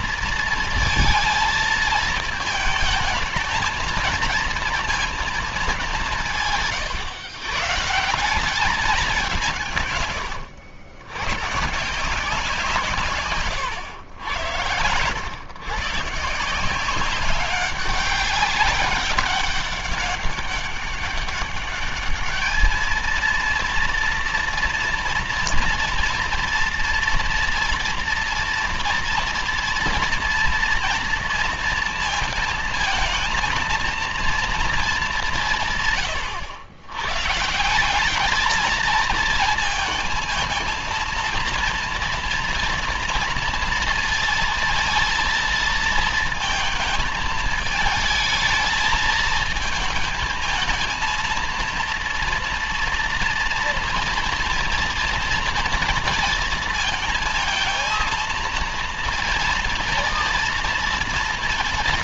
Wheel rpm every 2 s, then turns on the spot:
230, 220, 220, 130, 190, 110, 140, 100, 190, 200, 200, 230, 230, 230, 230, 230, 220, 190, 120, 220, 230, 240, 230, 220, 220, 230, 230, 230, 230, 230, 230.
12-14